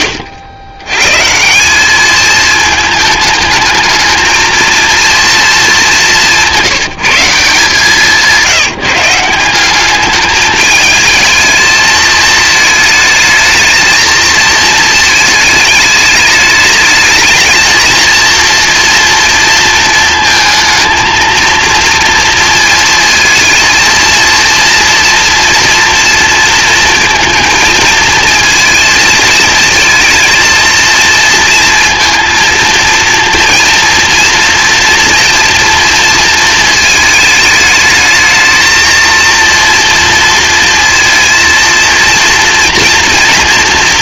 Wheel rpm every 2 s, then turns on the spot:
120, 210, 230, 180, 160, 220, 220, 220, 220, 230, 230, 230, 230, 230, 220, 230, 230, 240, 220, 230, 230, 230.
none